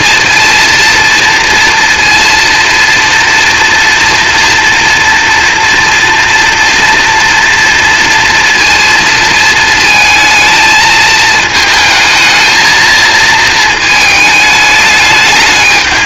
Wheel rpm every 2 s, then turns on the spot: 230, 230, 240, 240, 230, 220, 230, 220.
none